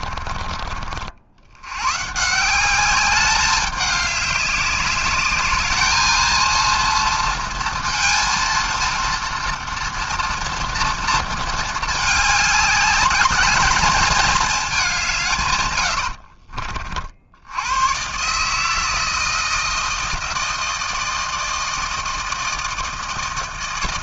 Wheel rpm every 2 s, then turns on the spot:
80, 200, 210, 230, 230, 230, 210, 150, 90, 160, 160, 160.
none